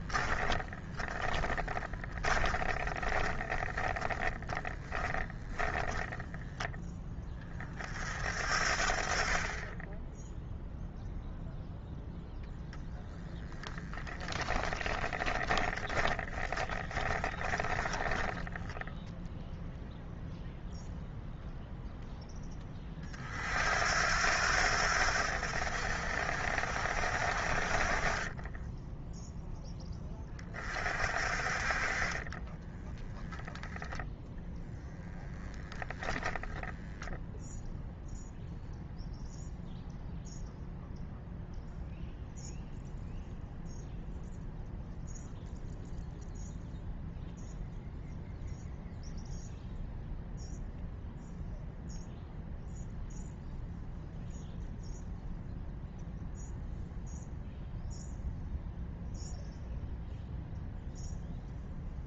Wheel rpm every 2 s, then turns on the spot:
20, 20, 10, 10, 50, 0, 0, 10, 10, 0, 0, 10, 80, 60, 10, 30, 20, 0, 0, 0, 0, 0, 0, 0, 0, 0, 0, 0, 0, 0, 0.
0-6 14-18 28-30 32-34